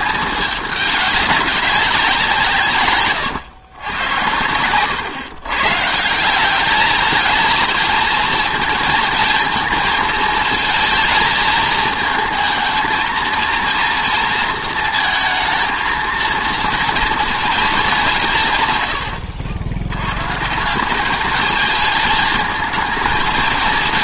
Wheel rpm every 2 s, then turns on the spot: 210, 160, 100, 200, 230, 220, 230, 230, 230, 130, 170, 220.
4-6